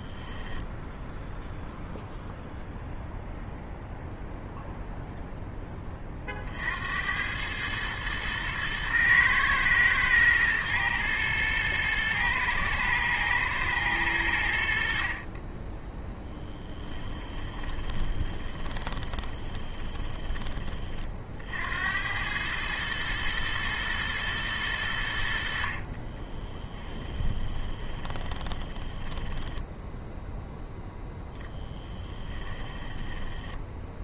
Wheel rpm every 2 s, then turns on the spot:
10, 0, 0, 60, 110, 120, 120, 60, 10, 20, 30, 110, 100, 20, 30, 0, 20.
0-2 16-20 26-30 32-34